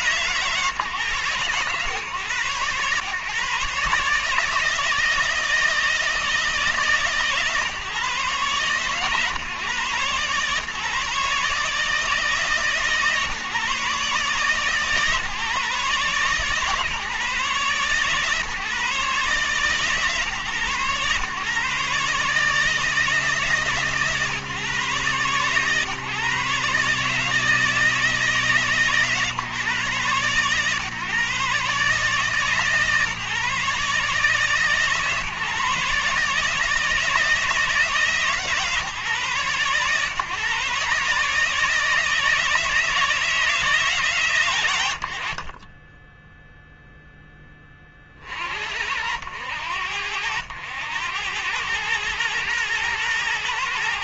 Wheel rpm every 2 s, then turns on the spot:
120, 130, 160, 150, 140, 140, 150, 150, 140, 140, 130, 160, 130, 140, 140, 140, 150, 140, 150, 150, 150, 160, 90, 0, 60, 90, 110.
none